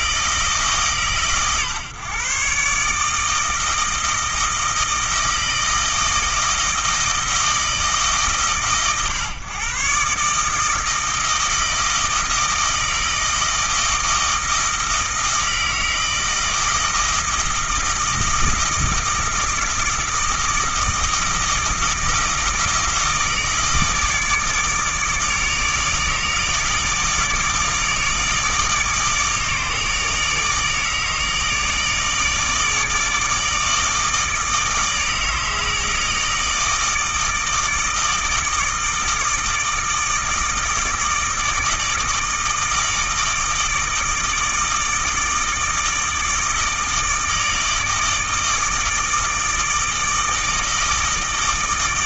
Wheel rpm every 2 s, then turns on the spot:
150, 150, 160, 160, 130, 160, 160, 160, 160, 160, 160, 160, 150, 150, 150, 150, 150, 160, 160, 160, 160, 160, 160, 160, 160, 160.
none